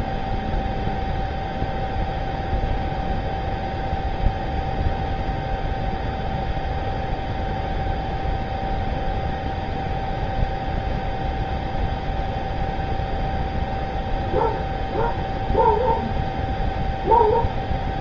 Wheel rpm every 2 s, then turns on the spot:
0, 0, 0, 0, 0, 0, 0, 0, 0.
none